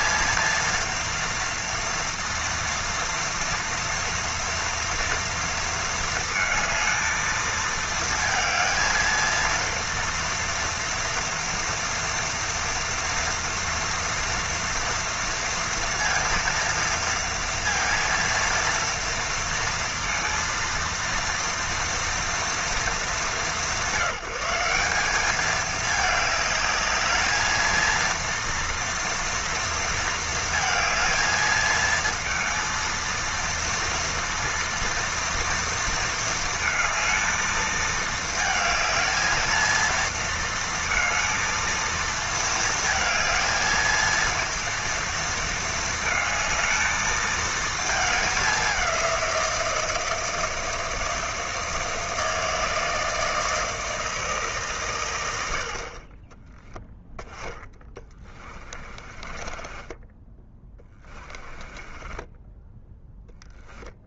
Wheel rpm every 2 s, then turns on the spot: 230, 230, 230, 220, 220, 240, 230, 230, 230, 230, 230, 220, 180, 210, 230, 220, 230, 230, 220, 220, 220, 220, 230, 220, 200, 160, 160, 140, 10, 30, 10, 10.
58-64